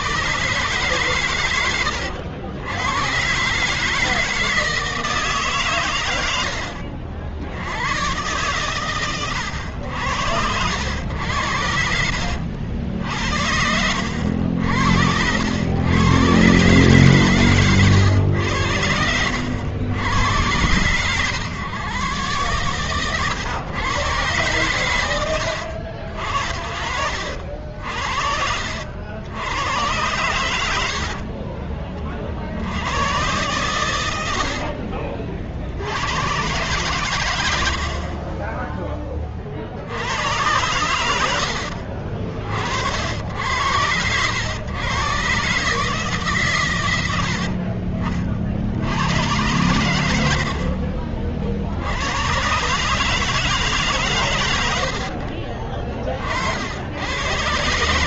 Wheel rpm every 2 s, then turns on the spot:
130, 90, 160, 100, 110, 90, 70, 80, 120, 90, 100, 120, 120, 60, 70, 90, 70, 70, 110, 20, 90, 50, 110, 130, 50, 70, 120, 120, 50.
34-36